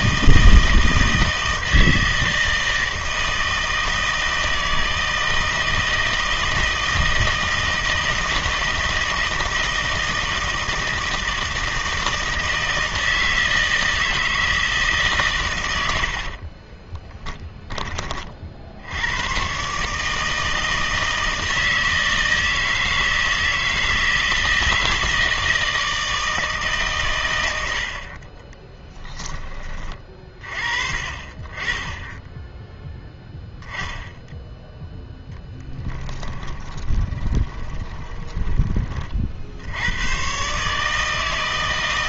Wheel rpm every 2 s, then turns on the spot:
160, 160, 160, 160, 160, 160, 160, 160, 40, 60, 160, 160, 160, 150, 20, 40, 10, 0, 20, 20, 140.
16-18 28-30 36-38